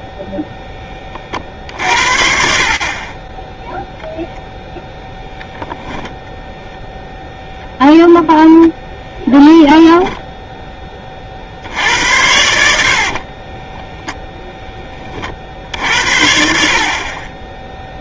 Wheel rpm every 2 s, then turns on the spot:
0, 20, 0, 0, 0, 10, 70, 10, 60.
12-14